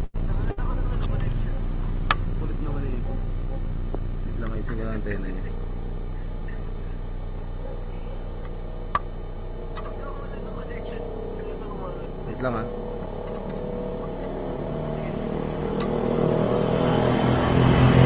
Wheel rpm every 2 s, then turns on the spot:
0, 0, 0, 0, 0, 0, 0, 0, 0.
none